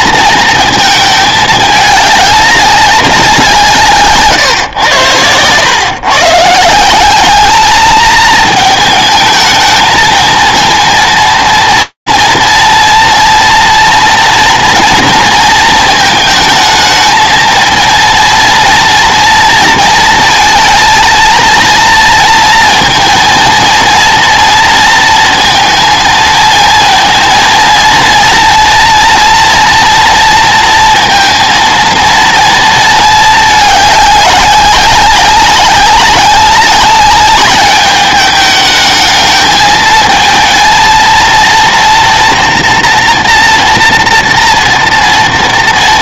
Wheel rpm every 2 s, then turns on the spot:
220, 200, 120, 160, 220, 230, 230, 230, 220, 230, 230, 230, 230, 230, 230, 230, 220, 200, 200, 210, 220, 230, 230.
none